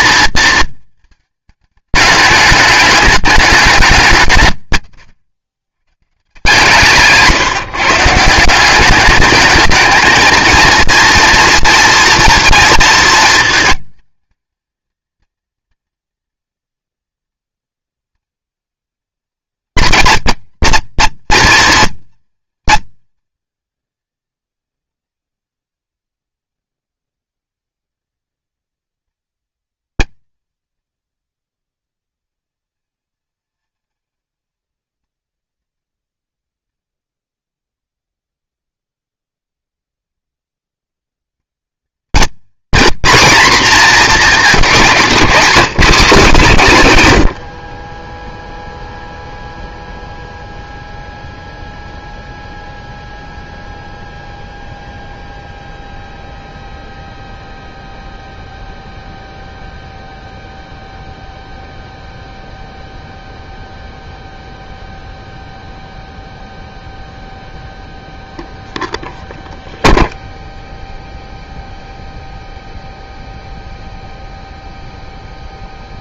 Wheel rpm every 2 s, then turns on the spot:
230, 210, 140, 150, 180, 230, 230, 220, 230, 220, 230, 230, 230, 190, 230, 230, 230, 220, 160, 130, 150, 230, 210, 170, 0, 0, 0, 0, 0, 0, 0, 0, 0, 0, 0, 0, 0, 0.
none